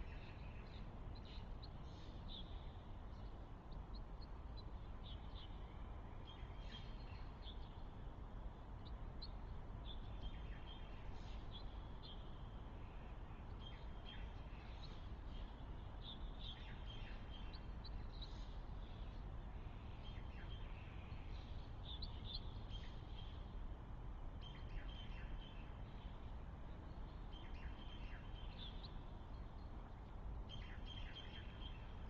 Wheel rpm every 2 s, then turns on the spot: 0, 0, 0, 0, 0, 0, 0, 0, 0, 0, 0, 0, 0, 0, 0, 0.
none